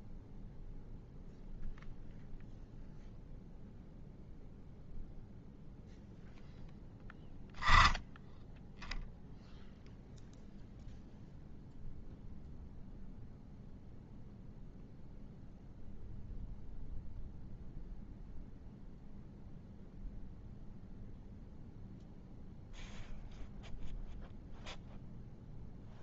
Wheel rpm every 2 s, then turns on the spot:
0, 0, 0, 10, 0, 0, 0, 0, 0, 0, 0, 0, 0.
none